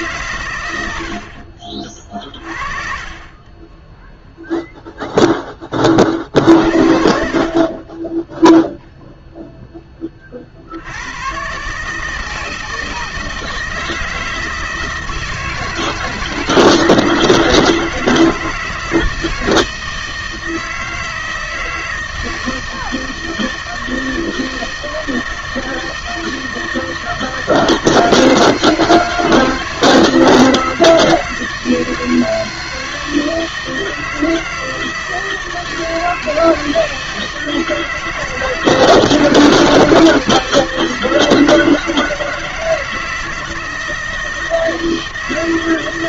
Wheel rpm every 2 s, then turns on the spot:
100, 30, 0, 50, 0, 60, 160, 160, 160, 160, 160, 160, 160, 160, 160, 160, 160, 160, 160, 160, 160, 160, 160.
none